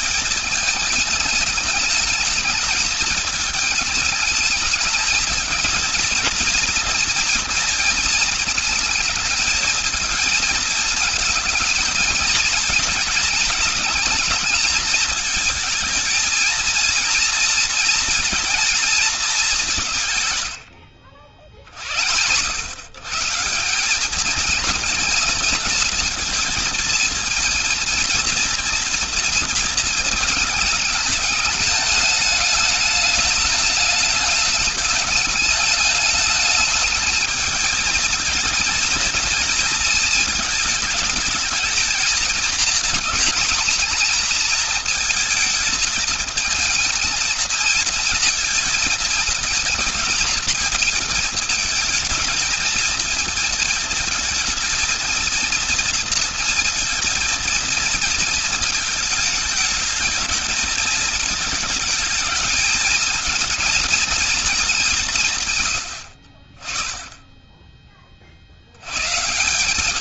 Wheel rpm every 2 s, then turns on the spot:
210, 210, 220, 230, 220, 220, 230, 220, 230, 220, 80, 130, 220, 230, 230, 210, 210, 210, 220, 230, 220, 230, 230, 220, 220, 220, 220, 220, 230, 220, 220, 220, 190, 30, 90.
20-22